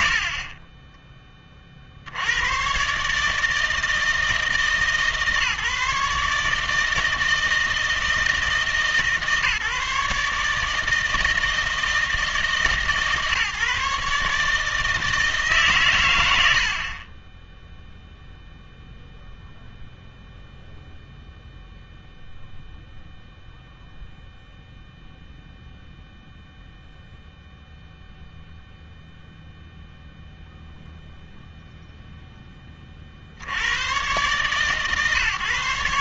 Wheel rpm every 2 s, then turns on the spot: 50, 120, 150, 150, 160, 150, 150, 150, 70, 0, 0, 0, 0, 0, 0, 0, 10, 130.
0-2